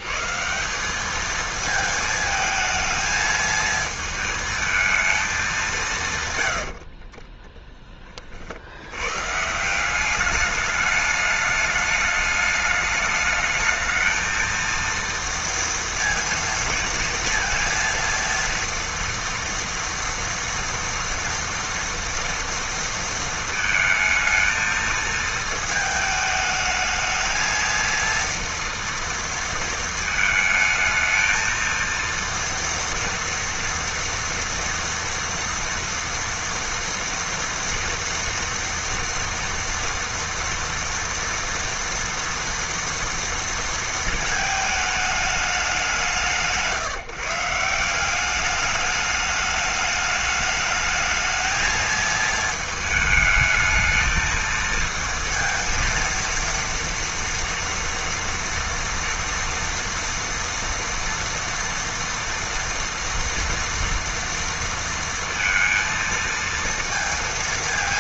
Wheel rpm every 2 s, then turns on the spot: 180, 220, 220, 70, 60, 210, 210, 230, 230, 230, 230, 230, 230, 220, 230, 220, 230, 230, 230, 230, 230, 230, 220, 140, 200, 220, 220, 230, 230, 230, 240, 230, 230, 230.
6-8